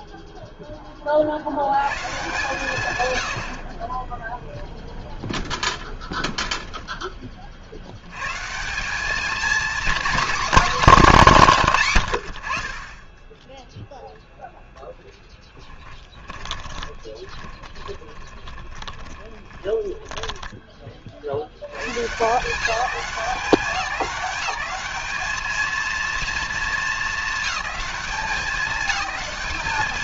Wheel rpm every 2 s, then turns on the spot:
0, 150, 0, 10, 150, 240, 50, 0, 20, 30, 20, 180, 200, 230, 200.
16-22